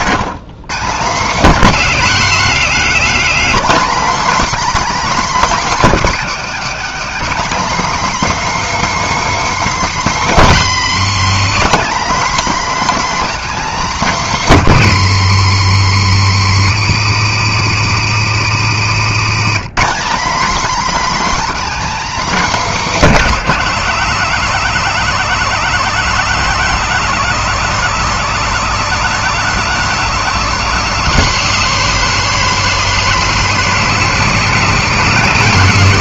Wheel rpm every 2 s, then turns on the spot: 160, 230, 290, 270, 310, 210, 280, 200, 150, 160, 280, 270, 230, 240, 230, 220, 220, 230.
18-20